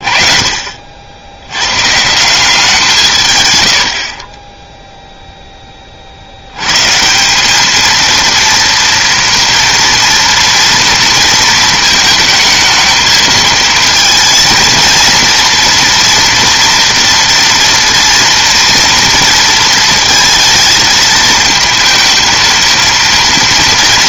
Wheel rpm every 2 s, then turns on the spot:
40, 170, 10, 110, 230, 230, 220, 230, 230, 230, 220, 230.
none